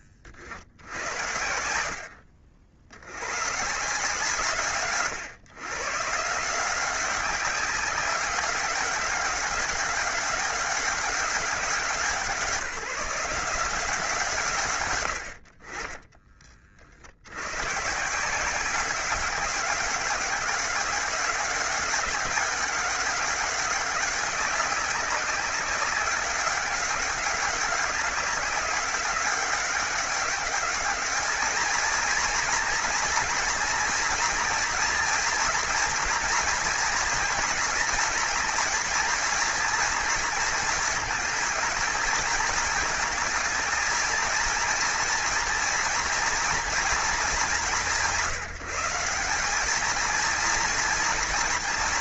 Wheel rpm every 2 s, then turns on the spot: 90, 80, 140, 180, 190, 200, 180, 110, 50, 190, 200, 200, 200, 200, 200, 210, 230, 230, 230, 230, 220, 220, 230, 230, 180, 230.
none